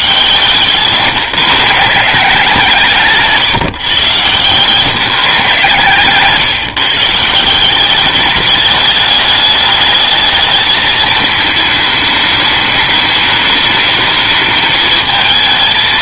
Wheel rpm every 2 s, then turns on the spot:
140, 170, 130, 150, 210, 220, 210, 220.
none